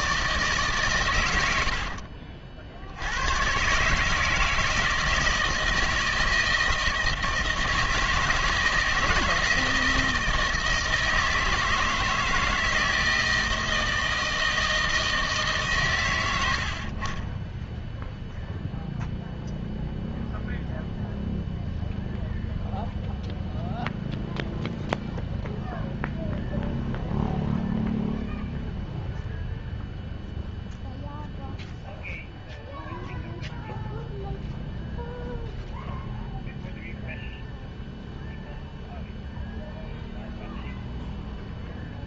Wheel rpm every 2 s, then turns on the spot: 150, 60, 160, 160, 160, 160, 160, 160, 70, 0, 0, 0, 0, 0, 0, 0, 0, 0, 0, 0, 0.
none